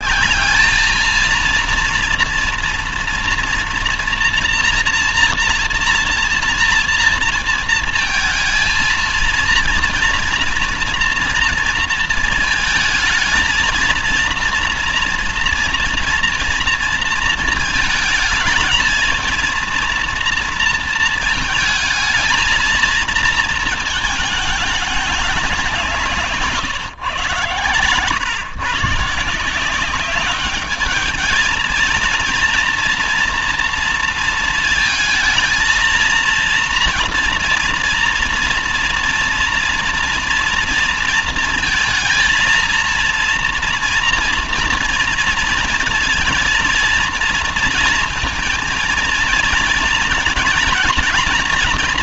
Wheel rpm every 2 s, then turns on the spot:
210, 230, 240, 230, 230, 230, 230, 230, 230, 220, 230, 220, 220, 150, 140, 200, 230, 230, 230, 230, 230, 230, 240, 230, 230, 230.
none